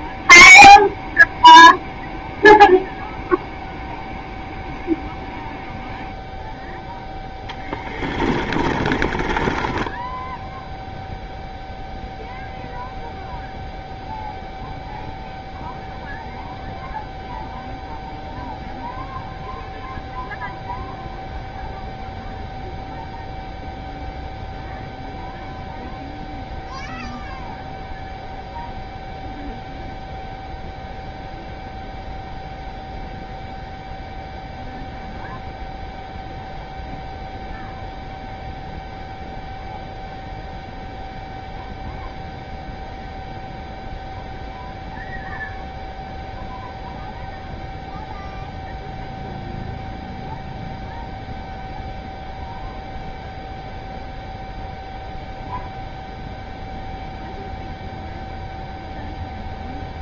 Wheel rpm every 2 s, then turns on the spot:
0, 0, 0, 0, 20, 0, 0, 0, 0, 0, 0, 0, 0, 0, 0, 0, 0, 0, 0, 0, 0, 0, 0, 0, 0, 0, 0, 0, 0, 0.
8-10